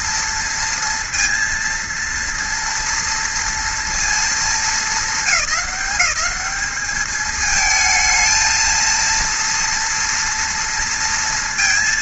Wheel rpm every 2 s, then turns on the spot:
230, 230, 220, 210, 230, 230.
none